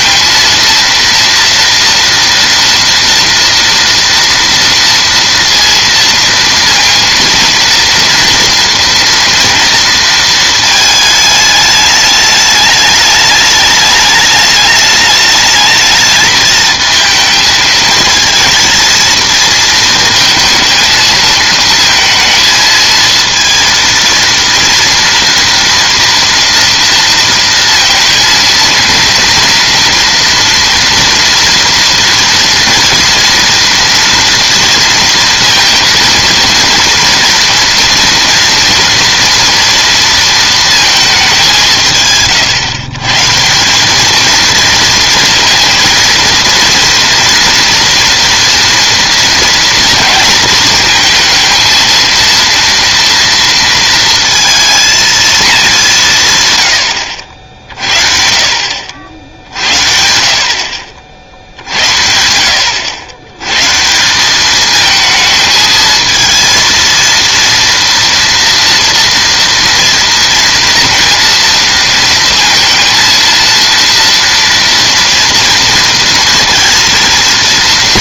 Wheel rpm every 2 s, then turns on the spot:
230, 230, 230, 230, 230, 220, 210, 210, 220, 220, 220, 220, 230, 230, 230, 230, 230, 230, 230, 230, 220, 130, 230, 230, 230, 230, 230, 230, 100, 60, 50, 80, 210, 230, 230, 230, 230, 230, 230.
none